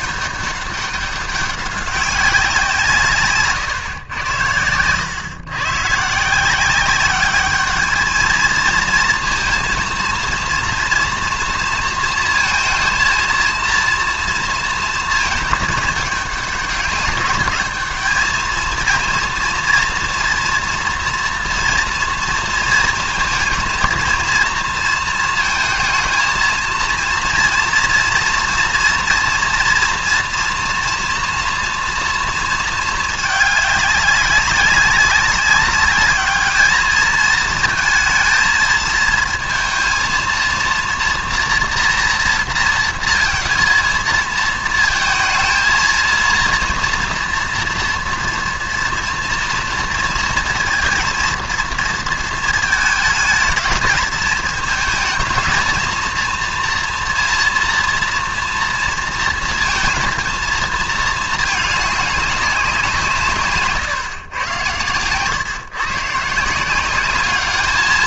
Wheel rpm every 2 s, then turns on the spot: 200, 180, 110, 180, 230, 230, 230, 230, 200, 220, 230, 230, 230, 230, 230, 230, 230, 200, 210, 220, 230, 230, 220, 230, 240, 230, 220, 220, 230, 230, 230, 180, 110, 170.
none